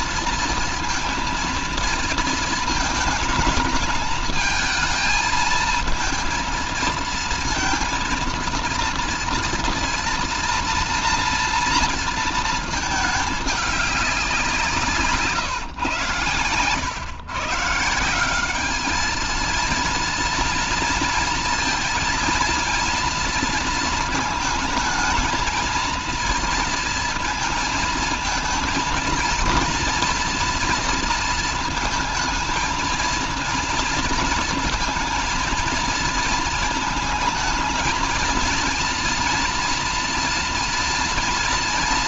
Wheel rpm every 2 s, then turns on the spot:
230, 220, 220, 230, 230, 230, 230, 170, 120, 200, 230, 230, 220, 230, 220, 230, 230, 230, 230, 230, 230.
none